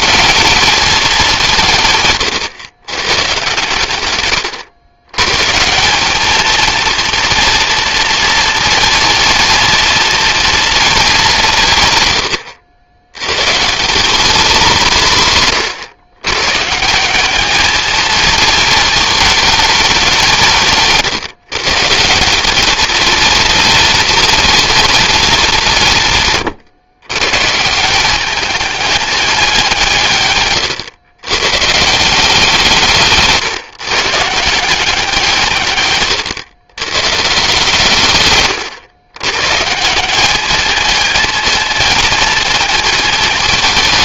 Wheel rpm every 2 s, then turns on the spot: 160, 120, 160, 230, 230, 170, 160, 130, 210, 210, 150, 230, 190, 170, 180, 130, 140, 140, 160, 150, 220, 220.
none